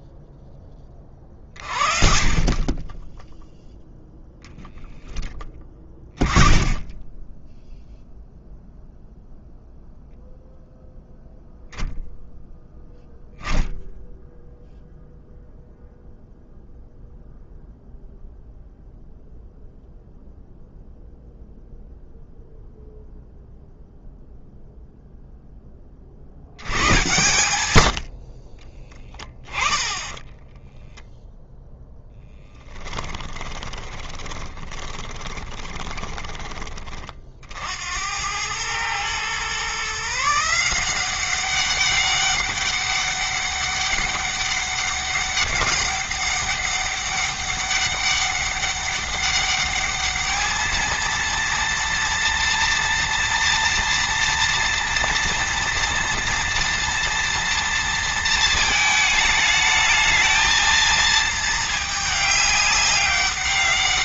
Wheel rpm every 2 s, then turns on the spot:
20, 10, 10, 20, 0, 0, 0, 0, 0, 0, 0, 0, 0, 100, 10, 10, 20, 20, 40, 120, 180, 200, 200, 200, 200, 220, 230, 230, 230, 220, 220, 200.
32-36